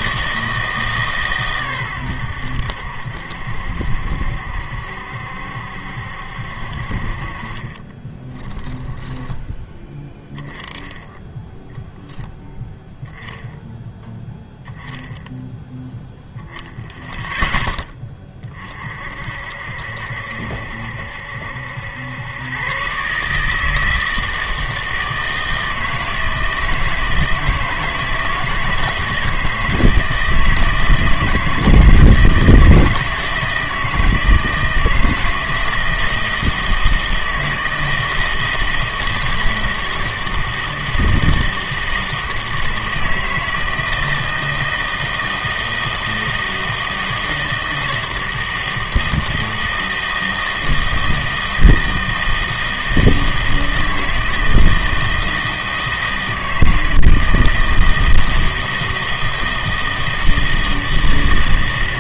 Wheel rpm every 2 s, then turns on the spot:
160, 80, 70, 60, 20, 10, 10, 10, 0, 40, 70, 120, 160, 160, 160, 160, 160, 160, 160, 160, 160, 160, 160, 160, 160, 160, 160, 160, 160, 160, 160.
8-10